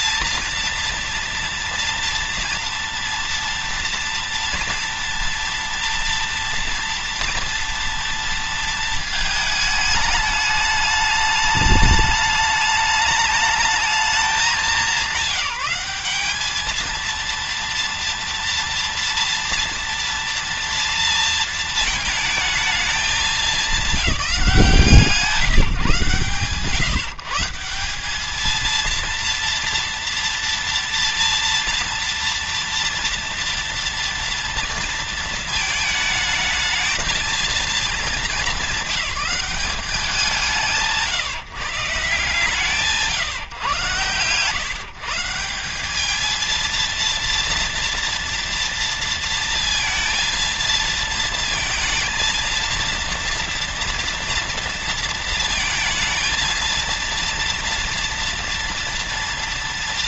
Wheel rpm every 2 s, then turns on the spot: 230, 230, 230, 230, 230, 210, 210, 200, 220, 230, 230, 220, 180, 150, 230, 230, 230, 230, 220, 200, 170, 160, 140, 230, 230, 230, 230, 230, 230, 230.
none